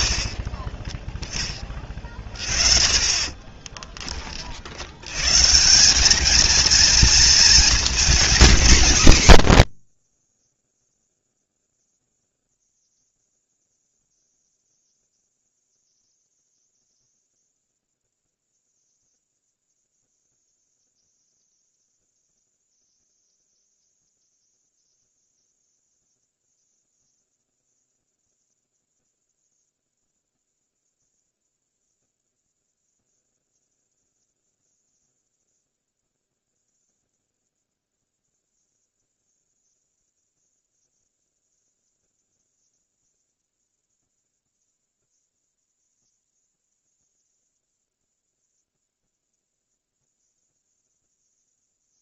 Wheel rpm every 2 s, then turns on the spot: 10, 30, 90, 230, 200, 20, 0, 0, 0, 0, 0, 0, 0, 0, 0, 0, 0, 0, 0, 0, 0, 0, 0, 0, 0, 0.
0-2